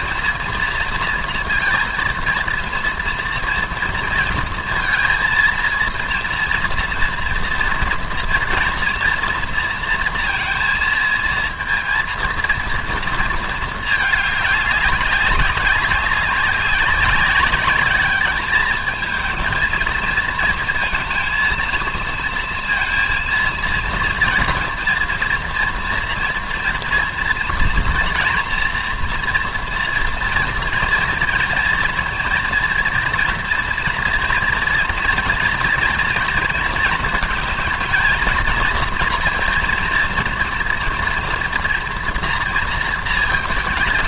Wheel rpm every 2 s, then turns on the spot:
230, 230, 230, 230, 230, 230, 230, 200, 190, 210, 230, 230, 230, 230, 240, 230, 230, 230, 230, 230, 230, 230.
none